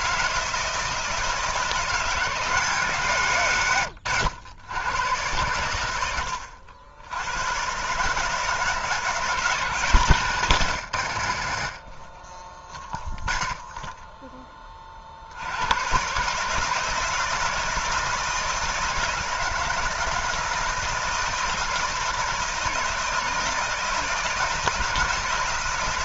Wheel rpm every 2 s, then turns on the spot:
160, 160, 110, 80, 160, 120, 20, 30, 160, 160, 160, 160, 160.
none